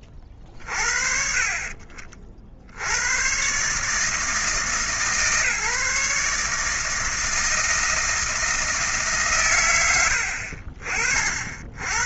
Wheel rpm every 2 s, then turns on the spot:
30, 60, 150, 150, 160, 50.
none